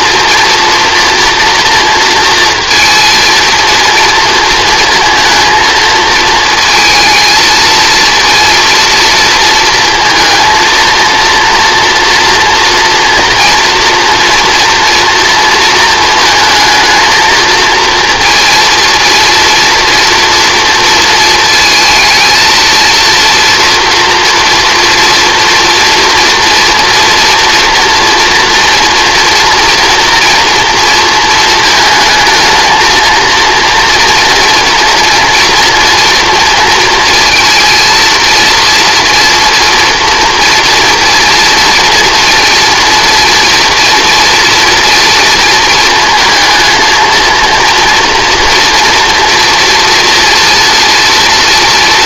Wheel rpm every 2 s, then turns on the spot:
230, 230, 230, 220, 230, 230, 230, 230, 220, 230, 230, 230, 230, 230, 240, 230, 220, 230, 230, 230, 230, 230, 230, 230, 230, 230.
none